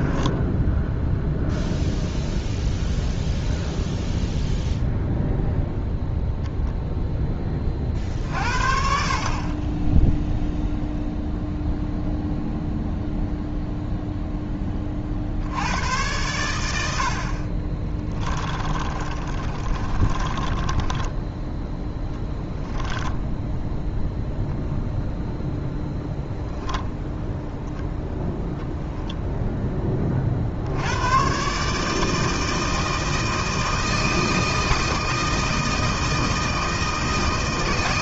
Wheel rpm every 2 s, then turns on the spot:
10, 0, 0, 0, 60, 0, 0, 20, 80, 30, 20, 20, 0, 0, 10, 80, 160, 160, 160.
18-24